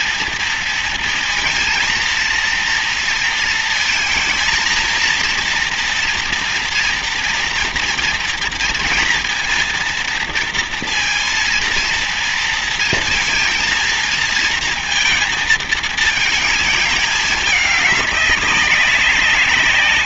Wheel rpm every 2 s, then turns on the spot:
230, 230, 230, 230, 230, 230, 230, 230, 220, 190.
none